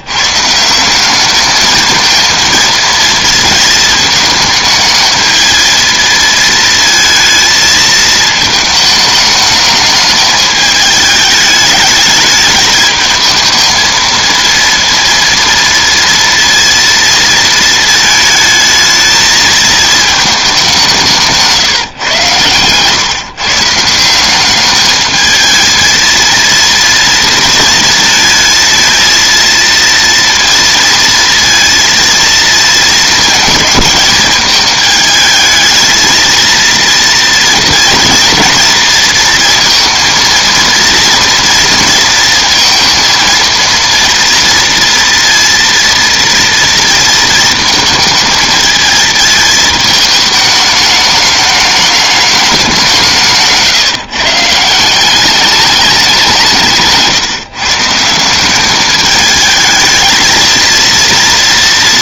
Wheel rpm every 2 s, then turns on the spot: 160, 230, 220, 230, 220, 210, 210, 230, 230, 220, 200, 120, 200, 230, 220, 230, 230, 210, 230, 230, 230, 230, 230, 230, 220, 220, 200, 170, 170, 200, 220.
none